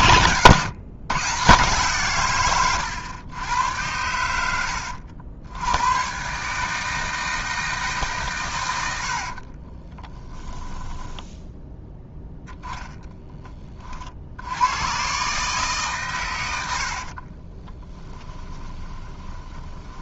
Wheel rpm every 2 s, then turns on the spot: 130, 110, 80, 150, 100, 10, 0, 100, 80, 20.
10-12 18-20